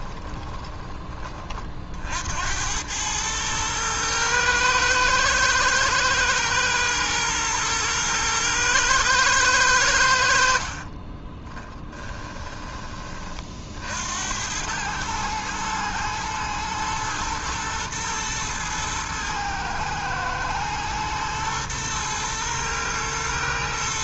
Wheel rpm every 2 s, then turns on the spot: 20, 90, 110, 110, 110, 50, 10, 100, 110, 110, 110, 110.
0-2 10-12